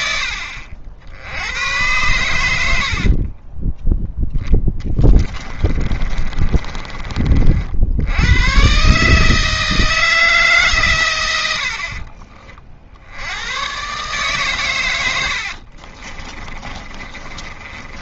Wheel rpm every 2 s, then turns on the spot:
60, 70, 10, 30, 130, 140, 60, 110, 30.
2-8 16-18